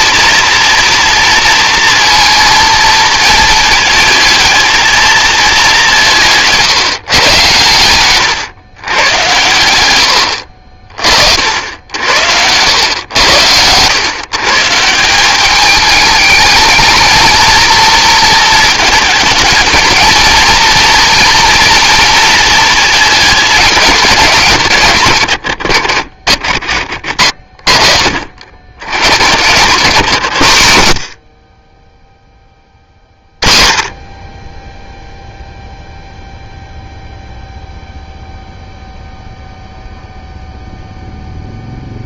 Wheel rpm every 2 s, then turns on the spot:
230, 230, 230, 150, 130, 40, 100, 160, 220, 220, 230, 220, 140, 50, 80, 100, 30, 10, 0, 0, 0.
10-12